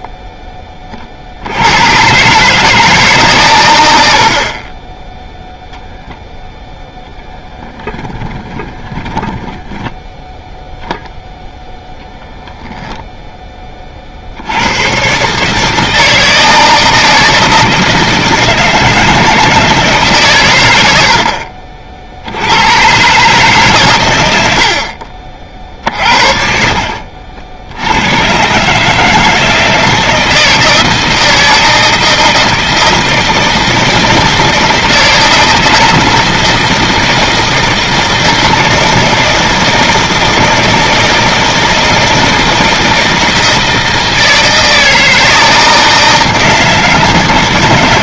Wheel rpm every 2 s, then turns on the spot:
20, 160, 30, 0, 20, 0, 0, 130, 160, 160, 70, 140, 40, 60, 160, 160, 160, 160, 160, 160, 160, 160, 160, 160.
8-10 24-28